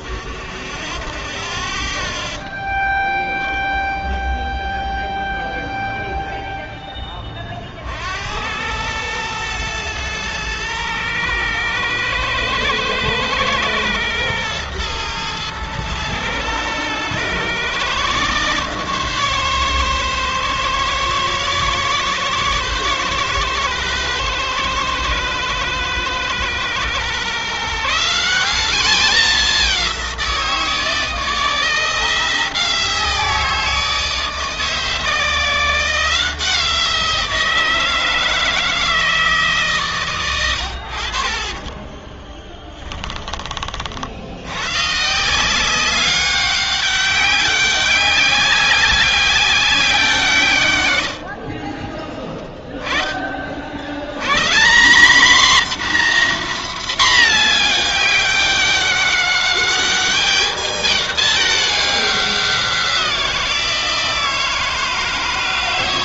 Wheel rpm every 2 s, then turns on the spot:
10, 0, 10, 0, 80, 110, 110, 110, 110, 130, 140, 140, 130, 120, 190, 180, 170, 160, 170, 160, 120, 20, 90, 190, 190, 140, 20, 100, 250, 200, 210, 190, 160.
42-44